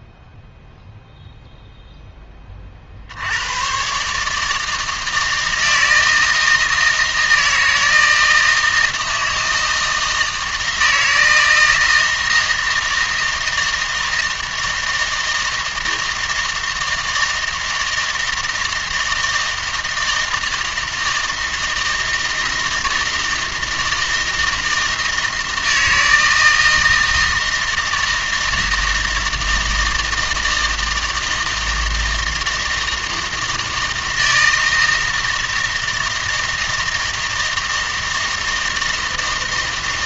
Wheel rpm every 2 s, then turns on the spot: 0, 40, 160, 160, 160, 160, 160, 160, 160, 160, 160, 160, 160, 160, 160, 160, 160, 160, 160, 160.
none